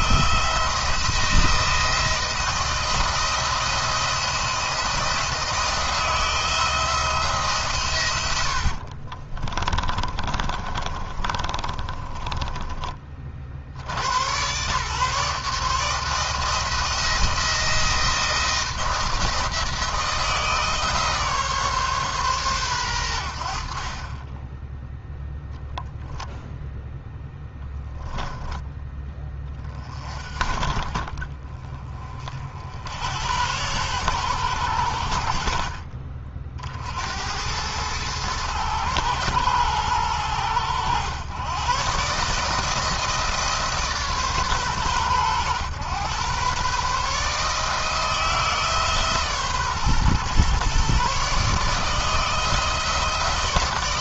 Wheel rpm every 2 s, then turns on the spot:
170, 170, 170, 160, 50, 40, 20, 130, 160, 170, 150, 110, 10, 0, 10, 50, 70, 90, 60, 110, 100, 160, 120, 130, 150, 140, 160.
8-12